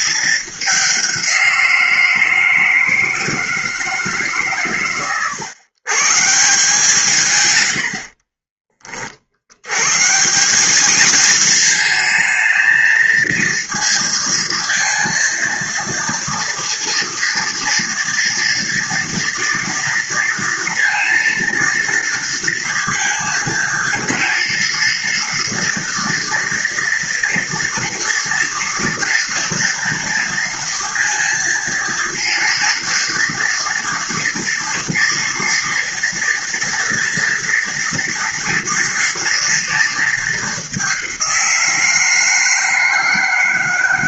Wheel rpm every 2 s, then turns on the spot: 190, 160, 110, 140, 50, 220, 220, 230, 230, 240, 230, 230, 230, 230, 230, 230, 230, 230, 230, 230, 190, 160.
none